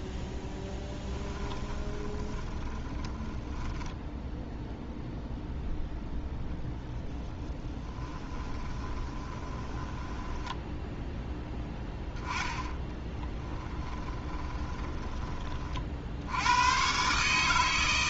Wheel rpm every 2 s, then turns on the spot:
10, 20, 0, 10, 20, 10, 10, 10, 110.
0-4 6-16